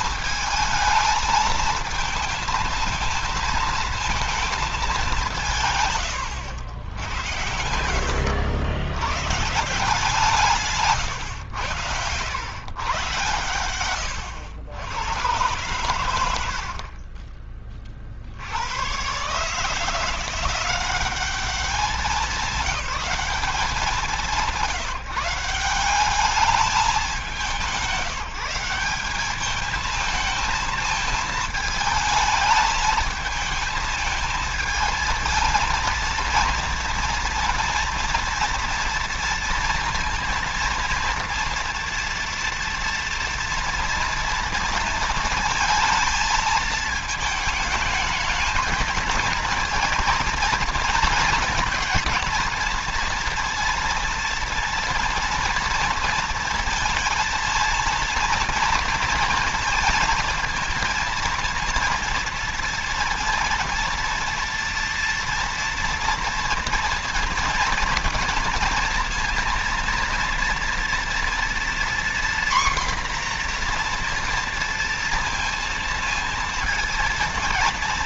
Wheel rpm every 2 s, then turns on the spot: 220, 230, 200, 100, 100, 140, 110, 90, 40, 110, 190, 200, 180, 200, 190, 220, 220, 220, 230, 230, 230, 230, 230, 220, 230, 230, 230, 230, 230, 230, 230, 230, 230, 230, 230, 230, 250, 230, 220.
none